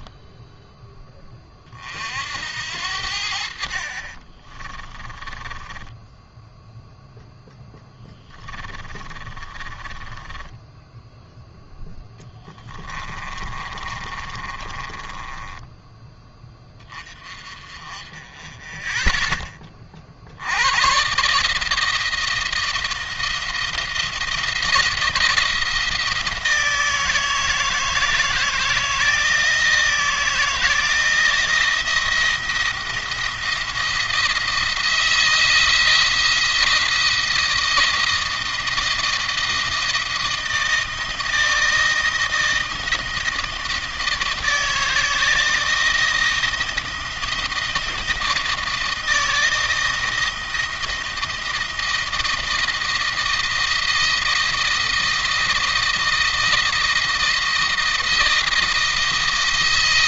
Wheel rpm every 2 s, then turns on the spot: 10, 70, 20, 10, 20, 10, 20, 20, 20, 10, 90, 170, 170, 160, 160, 160, 170, 170, 170, 160, 160, 160, 160, 160, 160, 160, 160, 160, 160, 170.
4-6 8-16